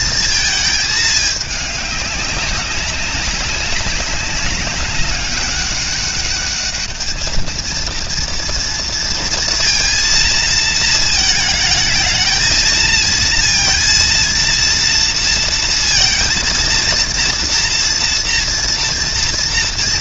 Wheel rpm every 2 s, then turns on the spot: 220, 200, 200, 210, 230, 230, 220, 230, 230, 230.
none